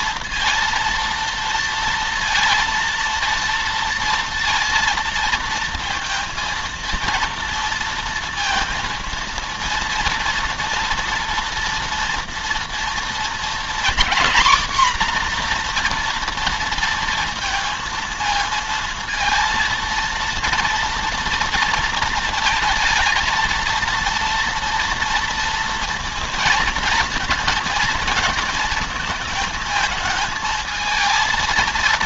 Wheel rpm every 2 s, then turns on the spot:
230, 230, 230, 230, 230, 230, 230, 260, 230, 230, 230, 230, 230, 230, 230, 220.
none